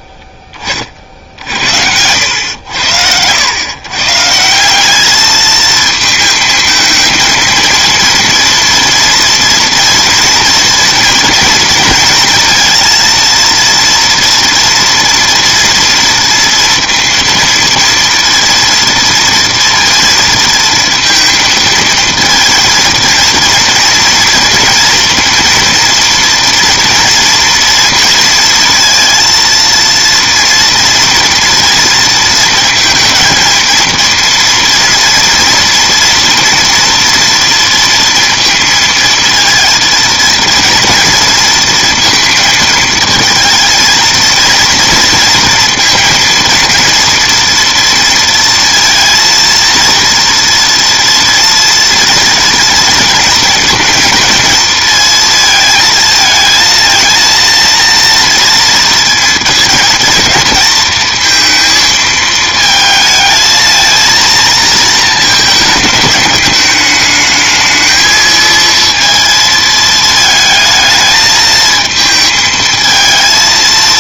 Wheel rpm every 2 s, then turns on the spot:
30, 80, 180, 220, 230, 230, 230, 230, 230, 230, 230, 220, 230, 230, 230, 230, 230, 230, 240, 230, 230, 220, 230, 230, 230, 230, 230, 230, 230, 230, 230, 220, 220, 210, 230, 220, 220.
none